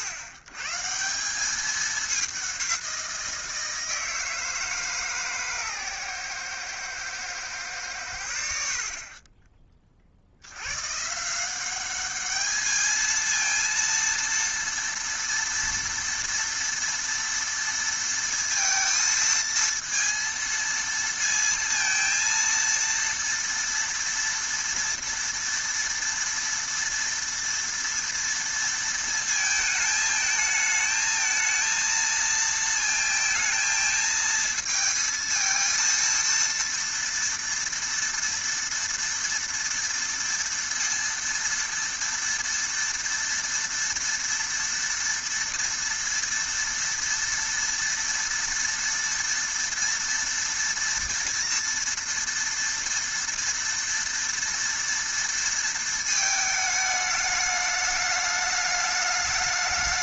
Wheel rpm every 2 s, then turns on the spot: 100, 190, 160, 120, 60, 100, 210, 230, 230, 230, 230, 230, 230, 230, 230, 220, 230, 220, 230, 230, 230, 230, 230, 230, 240, 230, 230, 230, 220, 210.
none